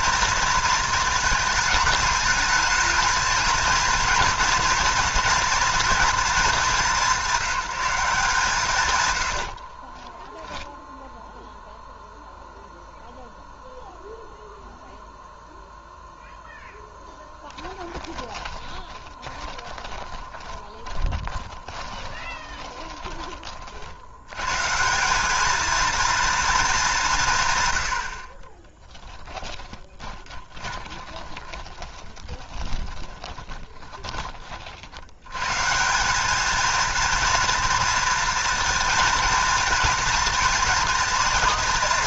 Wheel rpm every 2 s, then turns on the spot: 220, 220, 230, 190, 140, 0, 0, 0, 0, 20, 20, 40, 150, 210, 20, 20, 10, 50, 230, 230, 230.
18-24 28-34